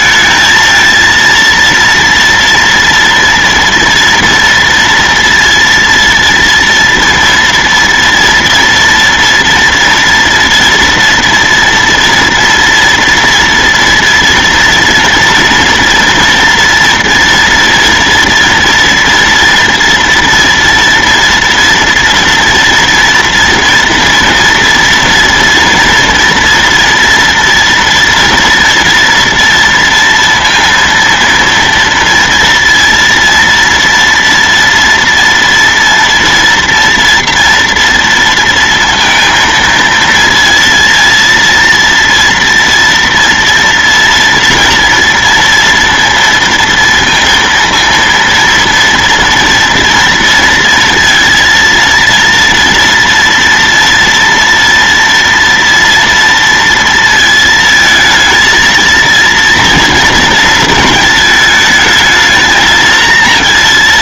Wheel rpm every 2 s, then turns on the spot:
230, 230, 230, 230, 230, 230, 240, 240, 230, 230, 230, 230, 230, 240, 240, 230, 230, 230, 230, 230, 230, 240, 230, 230, 230, 230, 230, 230, 230, 220, 230, 220.
none